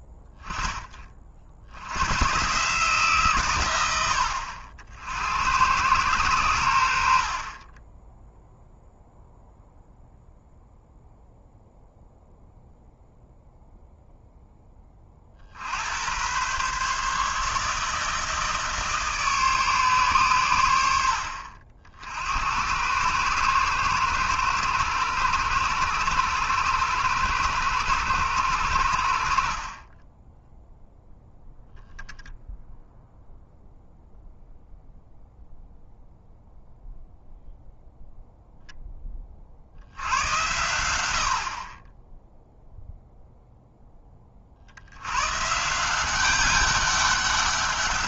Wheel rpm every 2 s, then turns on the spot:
10, 140, 70, 90, 0, 0, 0, 10, 130, 160, 100, 90, 110, 110, 90, 0, 0, 0, 0, 0, 80, 0, 70, 200.
none